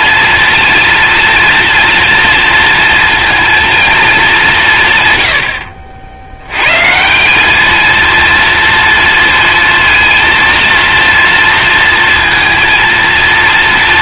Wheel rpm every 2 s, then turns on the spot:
230, 230, 180, 120, 230, 230, 230.
none